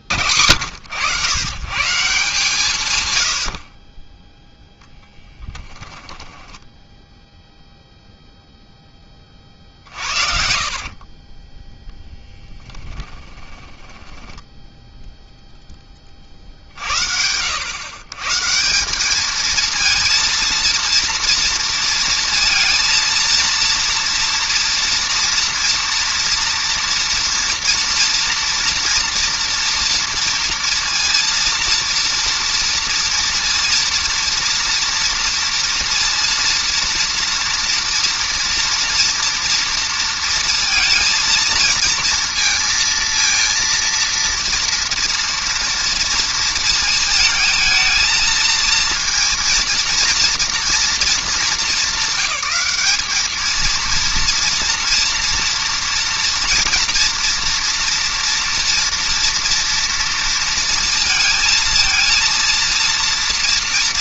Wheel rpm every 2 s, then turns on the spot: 100, 130, 10, 0, 50, 20, 20, 0, 100, 230, 230, 230, 230, 230, 230, 230, 230, 230, 230, 230, 230, 230, 230, 220, 230, 210, 220, 230, 240, 240, 230, 240.
4-6 8-14